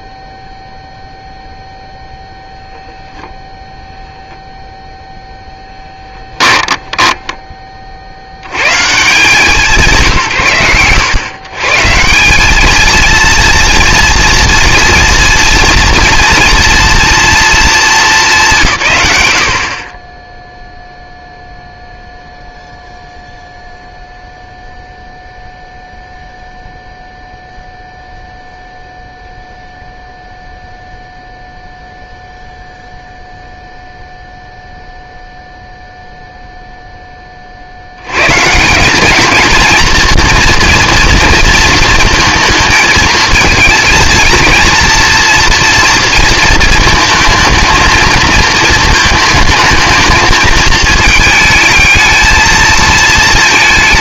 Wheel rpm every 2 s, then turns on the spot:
0, 0, 0, 10, 70, 100, 230, 230, 230, 170, 0, 0, 0, 0, 0, 0, 0, 0, 0, 180, 230, 220, 230, 220, 220, 220, 220.
6-8